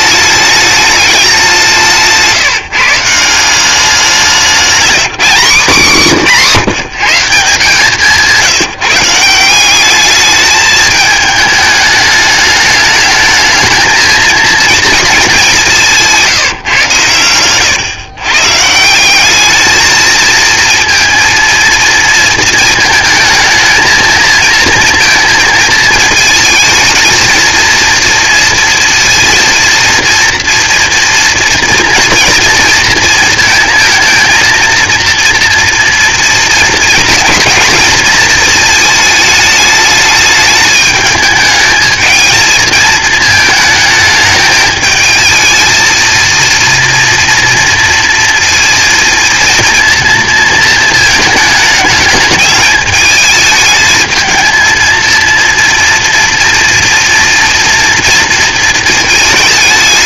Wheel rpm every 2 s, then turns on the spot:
210, 160, 190, 170, 170, 210, 210, 230, 140, 150, 230, 220, 230, 220, 230, 230, 230, 230, 230, 220, 210, 220, 220, 230, 230, 230, 210, 220, 230, 230.
none